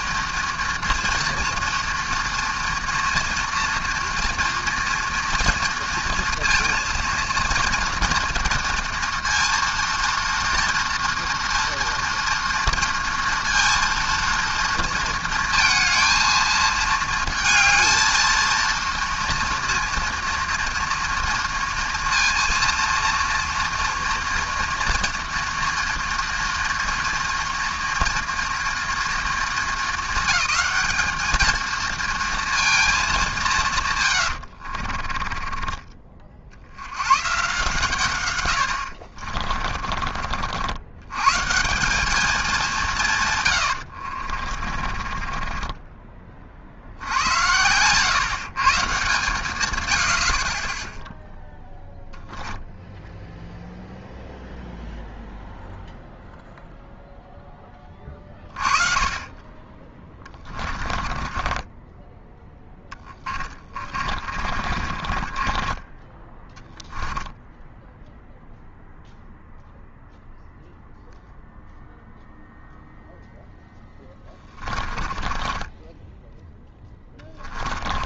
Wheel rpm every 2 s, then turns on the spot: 240, 230, 230, 230, 230, 230, 230, 230, 220, 230, 230, 230, 230, 230, 230, 220, 220, 60, 80, 80, 80, 180, 40, 50, 140, 30, 0, 0, 0, 30, 20, 10, 40, 10, 0, 0, 0, 30, 10.
34-36 38-40 44-46 60-68 74-78